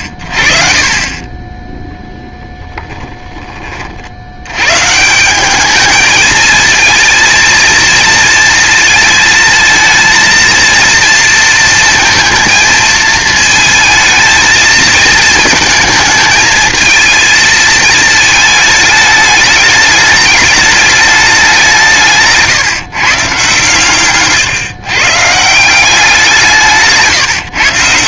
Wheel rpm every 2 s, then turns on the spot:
40, 10, 130, 230, 220, 230, 220, 220, 220, 210, 210, 150, 140, 160.
none